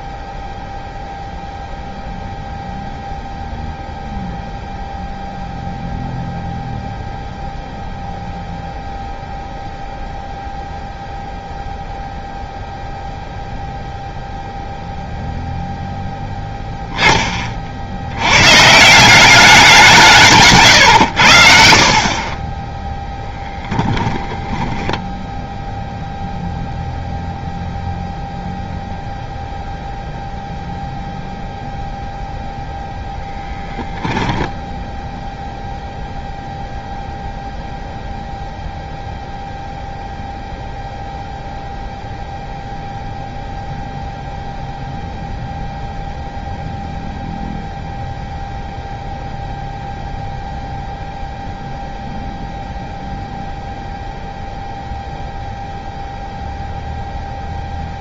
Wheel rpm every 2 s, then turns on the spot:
0, 0, 0, 0, 0, 0, 0, 0, 10, 150, 120, 10, 10, 0, 0, 0, 0, 10, 0, 0, 0, 0, 0, 0, 0, 0, 0, 0, 0.
24-26